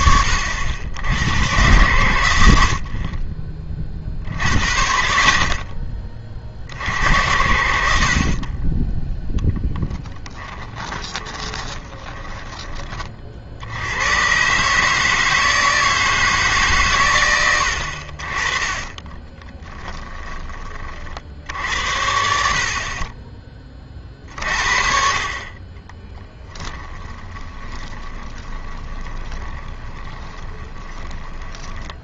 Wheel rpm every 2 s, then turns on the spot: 80, 70, 40, 70, 20, 10, 20, 140, 140, 30, 30, 50, 50, 10, 20, 20.
10-12 18-20 26-32